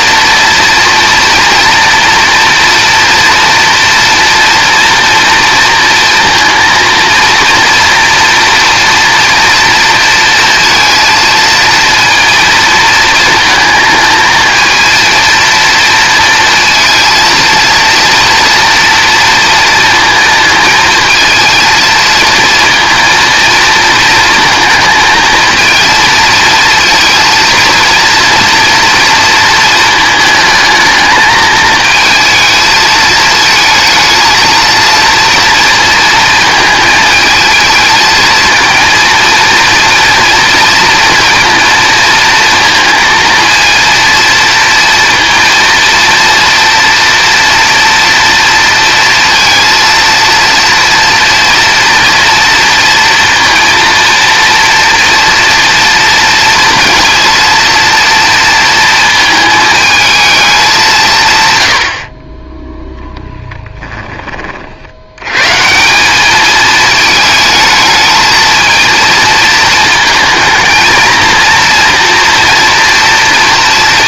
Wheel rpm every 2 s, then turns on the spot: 230, 240, 240, 230, 230, 230, 220, 230, 230, 240, 220, 230, 220, 230, 240, 220, 220, 230, 220, 230, 230, 230, 230, 230, 230, 230, 230, 230, 230, 230, 170, 0, 80, 220, 220, 230, 240.
none